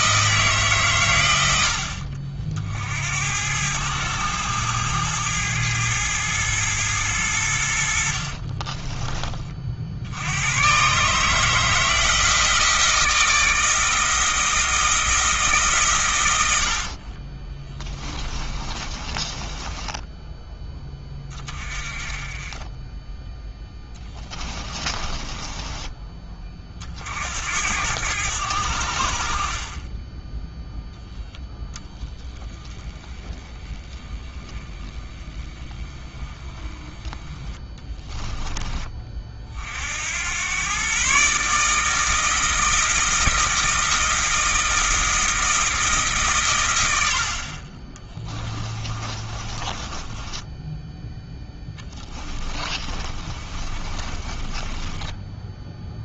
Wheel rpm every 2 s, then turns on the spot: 140, 60, 110, 110, 40, 120, 160, 160, 60, 20, 10, 20, 20, 40, 70, 10, 20, 20, 20, 20, 120, 160, 160, 100, 20, 10, 20, 20.
8-10 16-20 24-26 48-56